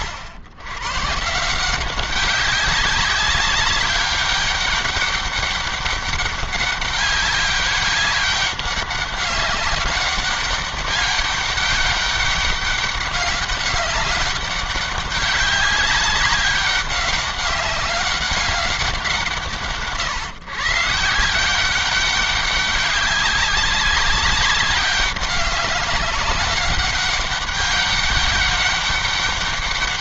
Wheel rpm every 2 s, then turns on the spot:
120, 190, 200, 200, 200, 200, 200, 190, 200, 190, 140, 200, 190, 200, 200.
none